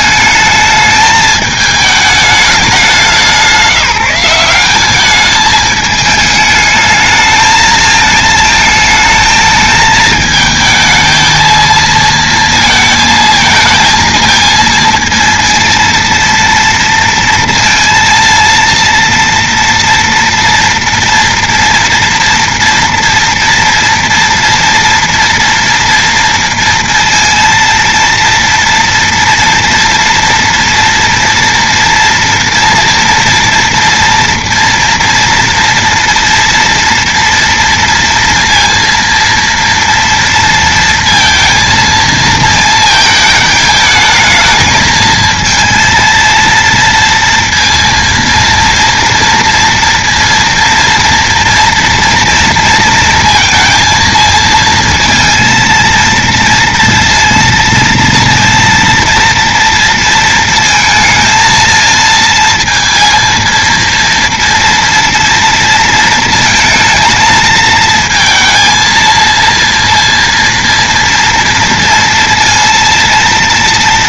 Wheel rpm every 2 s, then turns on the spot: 220, 200, 190, 210, 220, 220, 230, 230, 230, 230, 230, 230, 230, 230, 230, 230, 230, 230, 230, 230, 230, 220, 220, 230, 230, 230, 230, 220, 230, 230, 230, 230, 230, 220, 230, 230, 230.
none